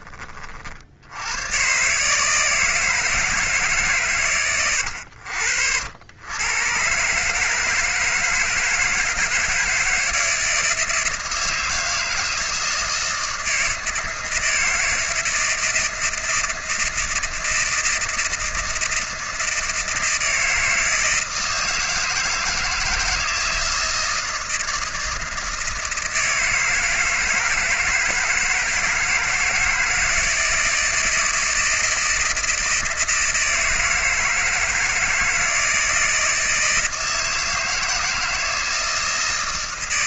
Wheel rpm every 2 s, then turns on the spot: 50, 150, 110, 110, 160, 160, 160, 160, 160, 160, 160, 160, 160, 160, 170, 160, 160, 160, 160, 160.
none